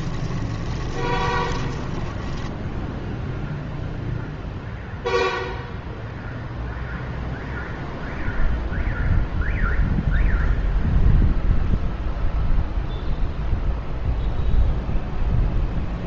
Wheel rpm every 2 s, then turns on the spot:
20, 10, 0, 0, 0, 0, 0, 0.
0-4